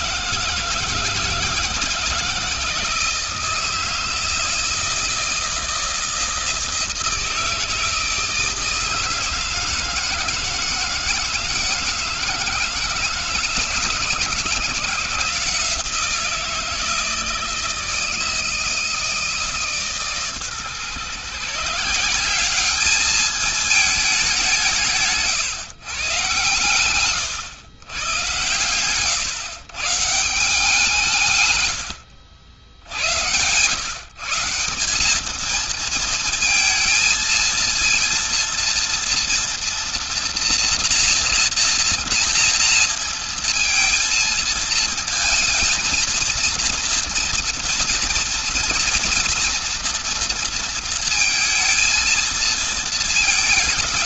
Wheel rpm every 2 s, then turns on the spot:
160, 160, 160, 160, 160, 160, 160, 160, 170, 160, 140, 200, 190, 130, 120, 170, 70, 170, 230, 230, 240, 230, 230, 230, 230, 230, 230.
none